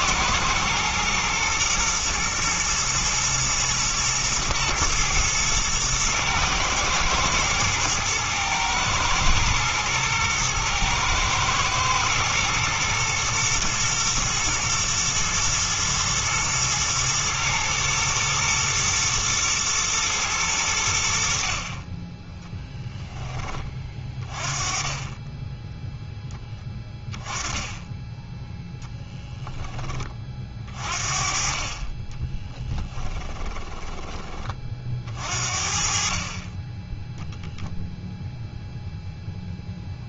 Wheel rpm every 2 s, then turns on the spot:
120, 110, 110, 110, 120, 110, 110, 110, 120, 110, 90, 0, 30, 20, 10, 40, 10, 40, 20, 0.
32-34